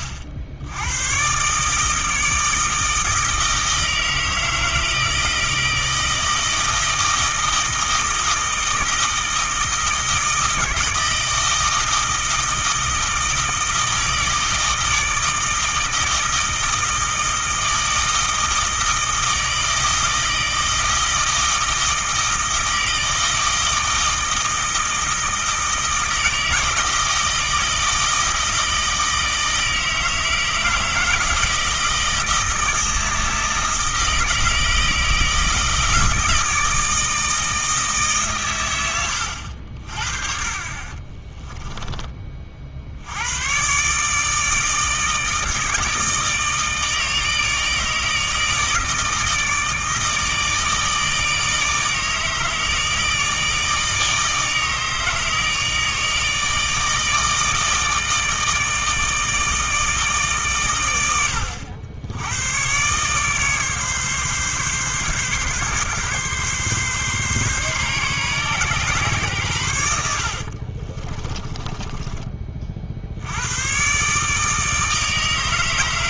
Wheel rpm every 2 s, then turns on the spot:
80, 160, 160, 160, 160, 160, 160, 160, 160, 160, 160, 160, 160, 160, 160, 160, 160, 160, 160, 110, 40, 60, 160, 160, 160, 160, 160, 160, 160, 160, 110, 120, 140, 140, 130, 40, 50, 160.
40-42 70-72